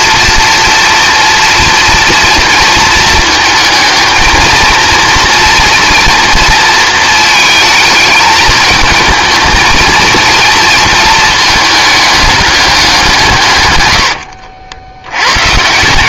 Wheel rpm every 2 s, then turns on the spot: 230, 230, 230, 230, 220, 220, 210, 90.
14-16